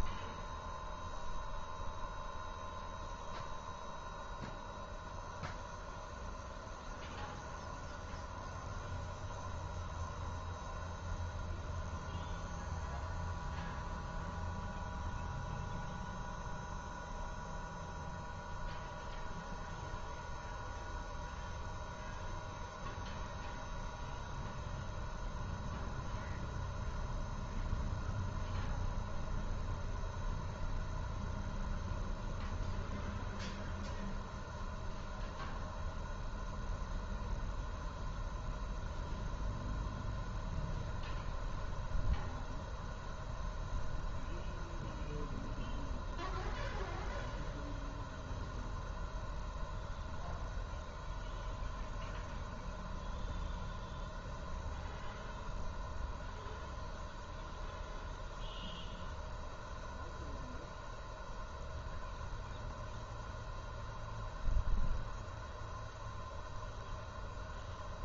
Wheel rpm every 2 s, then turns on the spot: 0, 0, 0, 0, 0, 0, 0, 0, 0, 0, 0, 0, 0, 0, 0, 0, 0, 0, 0, 0, 0, 0, 0, 0, 0, 0, 0, 0, 0, 0, 0, 0, 0, 0.
none